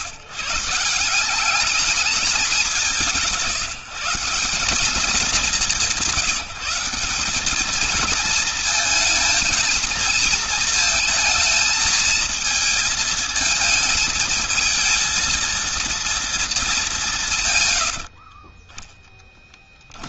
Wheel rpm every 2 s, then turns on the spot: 170, 200, 190, 170, 220, 220, 220, 220, 190, 20.
none